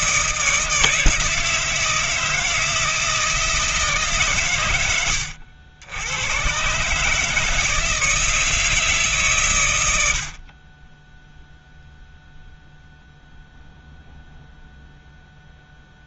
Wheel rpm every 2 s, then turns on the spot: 160, 160, 110, 120, 160, 30, 0, 0.
none